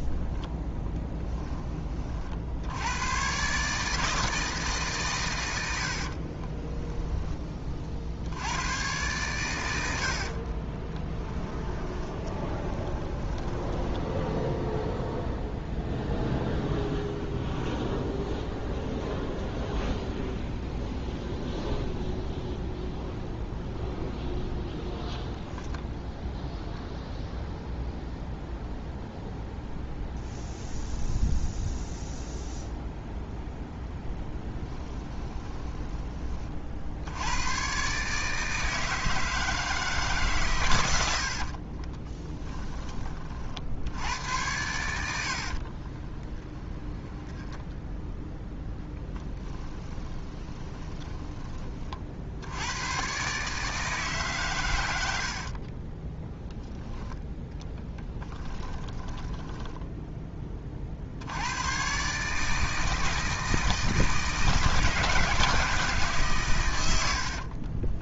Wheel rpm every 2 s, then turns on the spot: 10, 90, 140, 10, 110, 20, 10, 0, 0, 0, 0, 0, 0, 0, 0, 0, 0, 10, 70, 160, 90, 30, 90, 20, 10, 20, 120, 100, 10, 10, 50, 160, 160, 80.
10-14 34-36 40-42 44-52 58-60